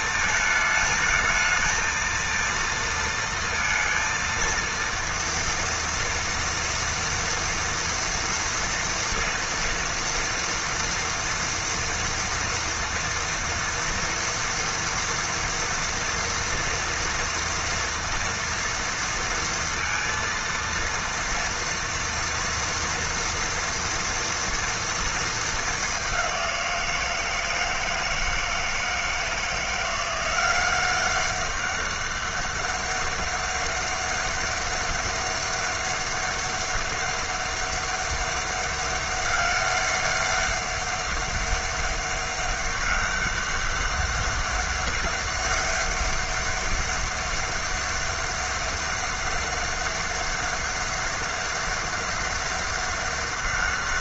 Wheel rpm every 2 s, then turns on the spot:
220, 230, 230, 240, 230, 230, 230, 230, 230, 230, 230, 230, 230, 170, 160, 190, 200, 200, 200, 200, 200, 200, 200, 200, 200, 200, 200.
none